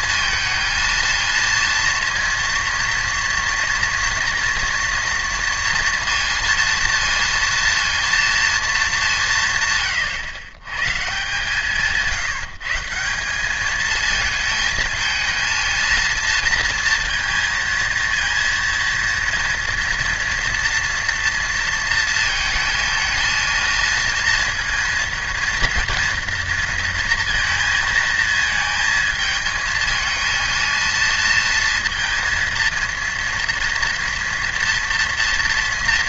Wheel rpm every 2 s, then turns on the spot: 230, 230, 240, 230, 220, 130, 160, 220, 230, 230, 230, 220, 230, 230, 230, 230, 230, 230.
none